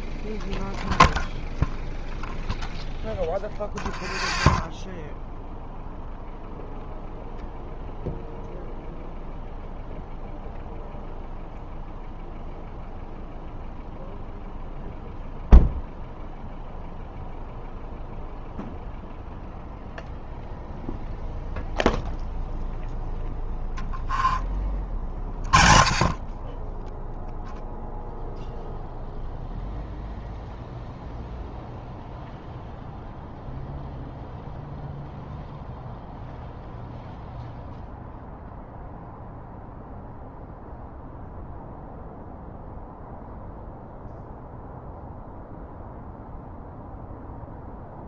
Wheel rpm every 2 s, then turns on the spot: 0, 0, 0, 0, 0, 0, 0, 0, 0, 0, 0, 0, 20, 10, 0, 0, 0, 0, 0, 0, 0, 0, 0, 0.
none